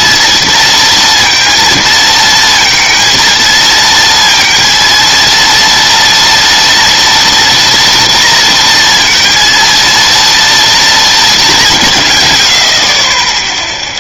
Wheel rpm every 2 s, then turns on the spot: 230, 230, 230, 230, 230, 220, 20.
none